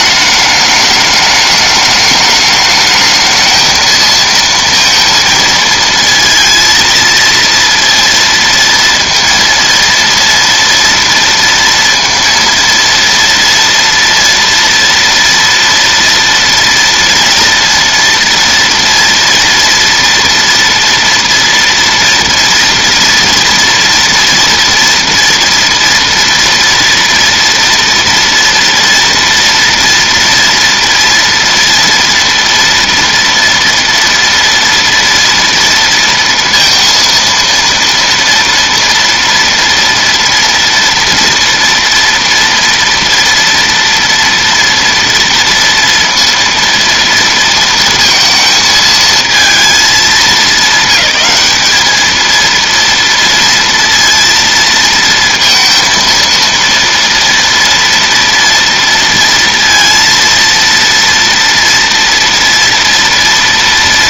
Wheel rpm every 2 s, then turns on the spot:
210, 210, 230, 230, 230, 230, 230, 230, 230, 230, 230, 230, 230, 230, 230, 230, 230, 230, 230, 230, 230, 230, 230, 230, 220, 200, 230, 230, 230, 230, 230, 230.
none